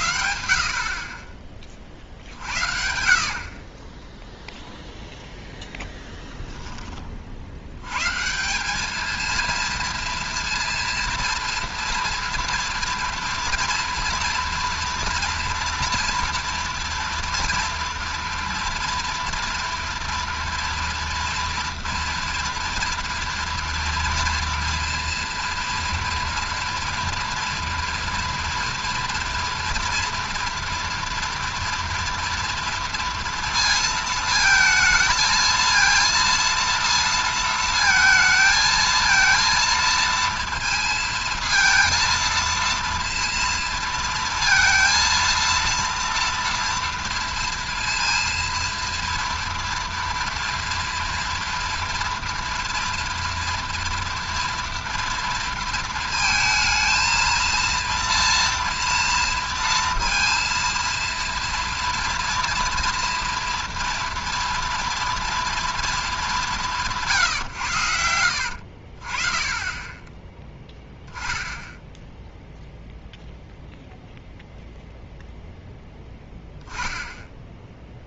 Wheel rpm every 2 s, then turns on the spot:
60, 70, 0, 10, 190, 230, 230, 230, 230, 240, 230, 230, 230, 230, 230, 230, 230, 220, 230, 220, 230, 230, 230, 230, 230, 230, 240, 230, 220, 240, 230, 230, 230, 190, 60, 10, 0, 0, 0.
none